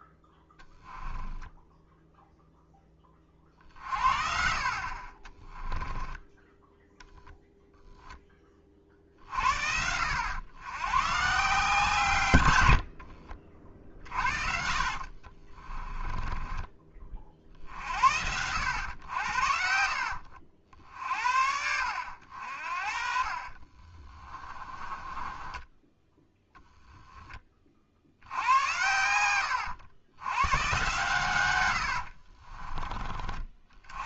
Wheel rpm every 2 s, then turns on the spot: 10, 10, 40, 0, 30, 120, 70, 50, 30, 90, 60, 50, 20, 10, 90, 130, 30.
0-2 12-16 22-26